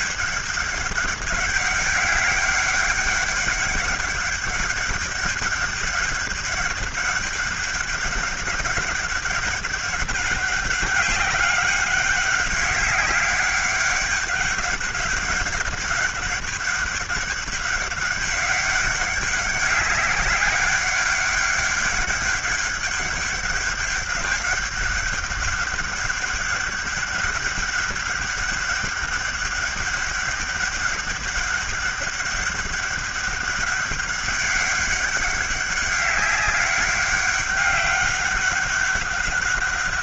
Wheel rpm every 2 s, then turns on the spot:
200, 200, 200, 200, 200, 190, 190, 200, 200, 200, 200, 200, 200, 200, 200, 200, 200, 200, 200, 200.
none